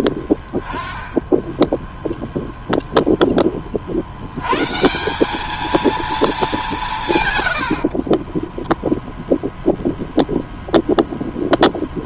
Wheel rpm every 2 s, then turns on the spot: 30, 0, 130, 200, 10, 0.
none